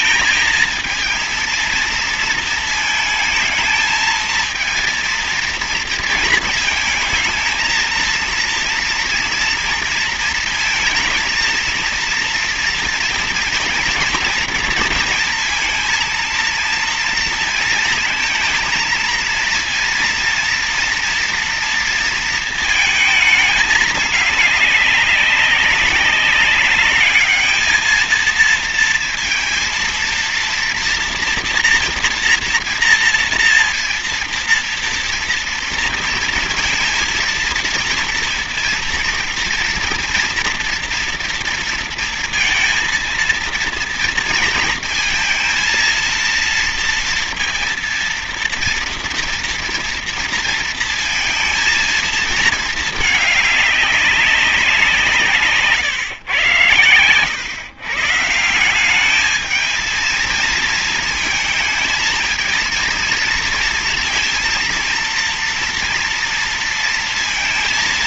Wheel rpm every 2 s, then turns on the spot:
220, 220, 230, 230, 230, 230, 230, 230, 230, 230, 230, 230, 210, 210, 230, 230, 230, 230, 220, 230, 230, 230, 230, 230, 230, 230, 220, 180, 110, 180, 230, 230, 230, 230.
none